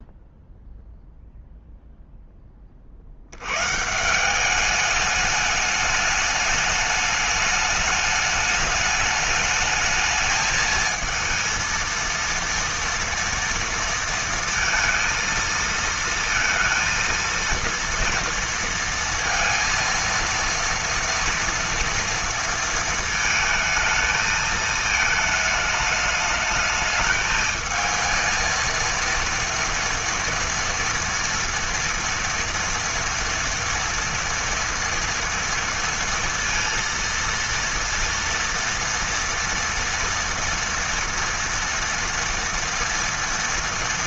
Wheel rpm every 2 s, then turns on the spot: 0, 40, 200, 210, 210, 220, 230, 230, 230, 230, 230, 230, 220, 220, 230, 230, 240, 230, 230, 230, 230, 240.
none